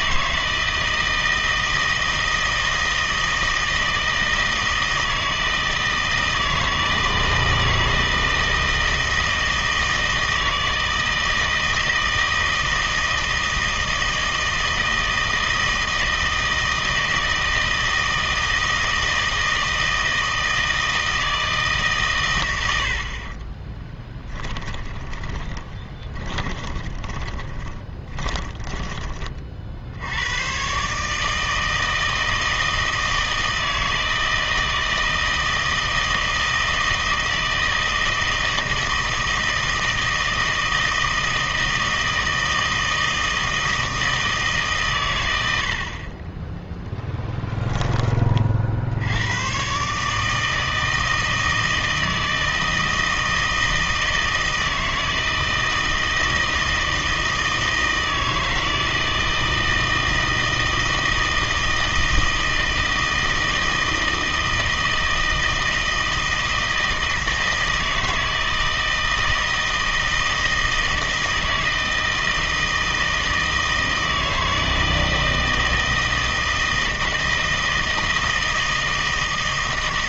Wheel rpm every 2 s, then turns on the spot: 160, 160, 160, 160, 160, 160, 160, 160, 160, 160, 160, 100, 20, 20, 20, 130, 160, 160, 160, 160, 160, 160, 140, 10, 60, 160, 160, 160, 160, 160, 160, 160, 160, 160, 160, 160, 160, 160, 160, 160.
24-28